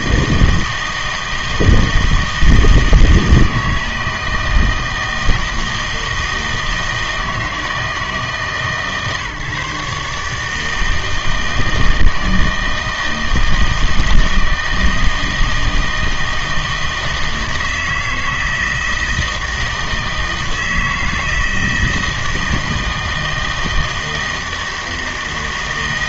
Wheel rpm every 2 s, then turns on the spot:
160, 160, 160, 160, 150, 160, 160, 160, 160, 160, 160, 160, 160.
none